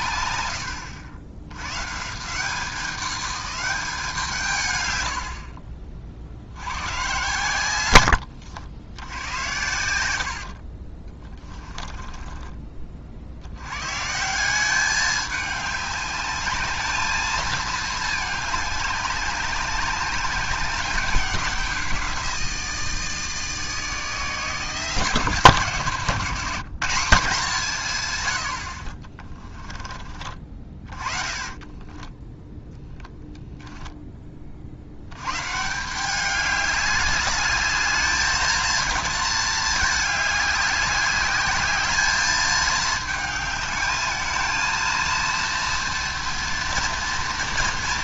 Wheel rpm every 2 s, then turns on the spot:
80, 190, 120, 100, 90, 40, 30, 190, 210, 200, 190, 170, 160, 190, 50, 30, 0, 60, 200, 230, 200, 220, 220, 230.
0-2 10-12 30-32